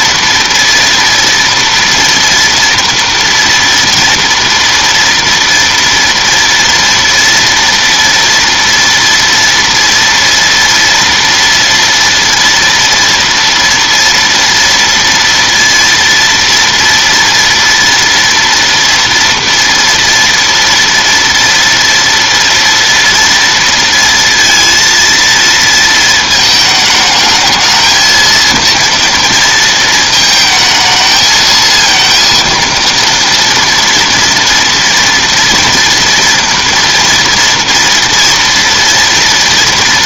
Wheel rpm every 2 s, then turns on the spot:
230, 230, 230, 230, 230, 230, 230, 230, 230, 230, 230, 230, 230, 220, 230, 220, 230, 230, 230, 230.
none